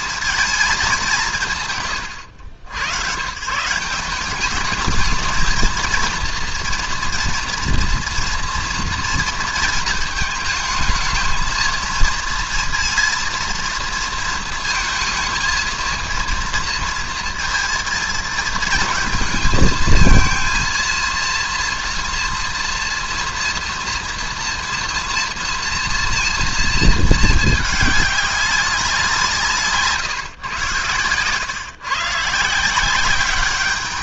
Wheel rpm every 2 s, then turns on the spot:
220, 100, 200, 230, 240, 220, 230, 220, 230, 220, 230, 230, 230, 230, 190, 120, 170.
none